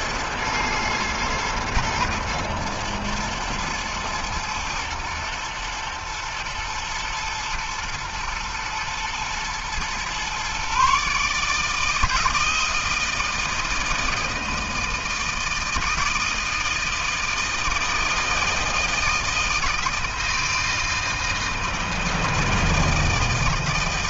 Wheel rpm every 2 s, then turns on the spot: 120, 110, 120, 110, 110, 140, 160, 160, 160, 160, 160, 160.
none